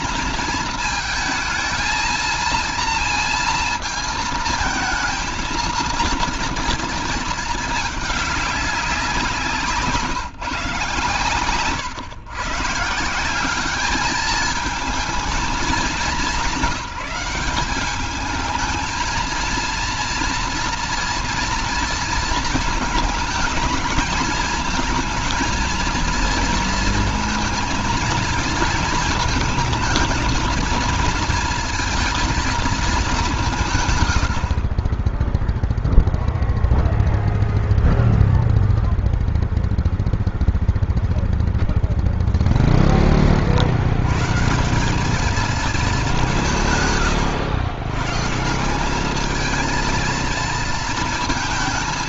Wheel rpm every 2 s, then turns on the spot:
220, 230, 220, 230, 190, 140, 170, 220, 190, 220, 230, 230, 220, 230, 230, 230, 210, 20, 0, 0, 0, 30, 180, 130, 200, 230.
none